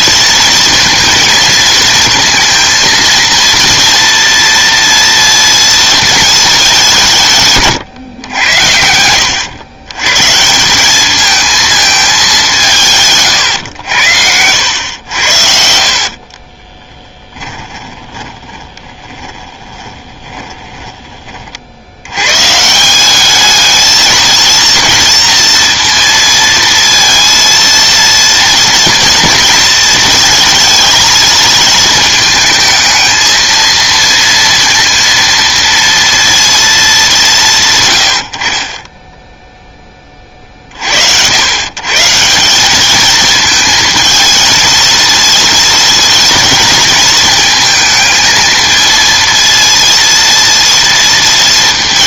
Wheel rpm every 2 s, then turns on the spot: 230, 230, 230, 210, 100, 160, 180, 90, 30, 10, 20, 140, 230, 230, 230, 230, 220, 230, 230, 50, 40, 180, 230, 230, 220, 230.
14-22